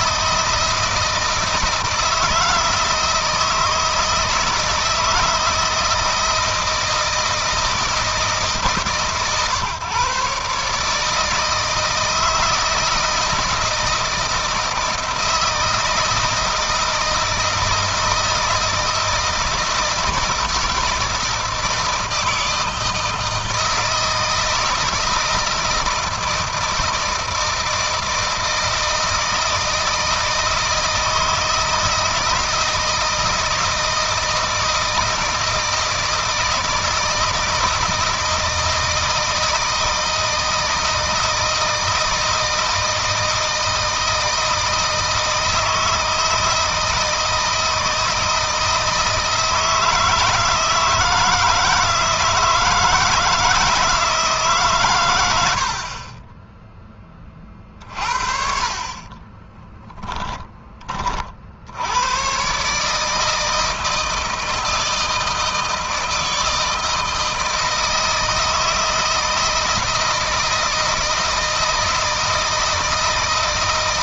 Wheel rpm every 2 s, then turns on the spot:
160, 160, 160, 160, 140, 150, 160, 160, 160, 160, 160, 160, 160, 160, 160, 160, 160, 160, 160, 160, 160, 160, 160, 160, 160, 160, 160, 130, 20, 40, 20, 140, 160, 160, 160, 160, 160.
58-60